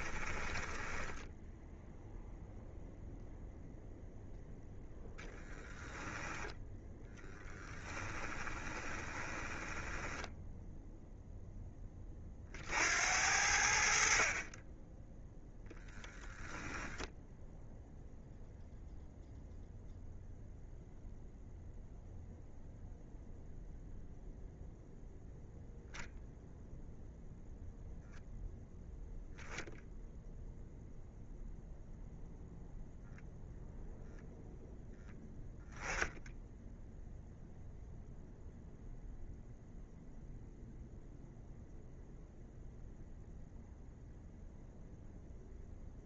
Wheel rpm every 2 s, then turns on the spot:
10, 0, 10, 10, 20, 0, 60, 10, 0, 0, 0, 0, 0, 0, 0, 0, 0, 0, 0, 0, 0, 0, 0.
0-2 8-10